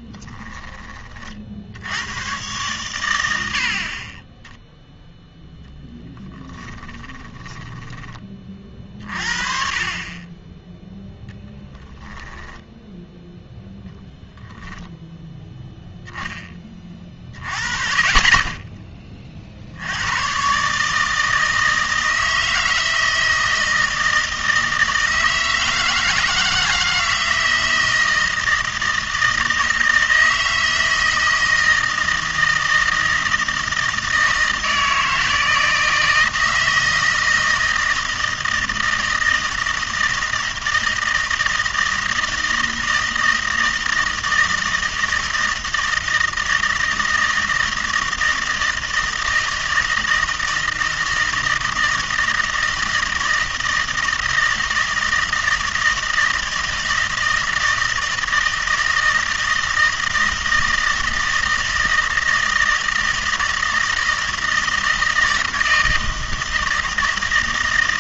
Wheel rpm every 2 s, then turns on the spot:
20, 120, 0, 10, 40, 10, 10, 10, 30, 20, 140, 160, 160, 170, 160, 160, 160, 160, 160, 160, 160, 160, 160, 160, 160, 160, 160, 160, 160, 160, 160, 160, 160, 160.
6-8 12-14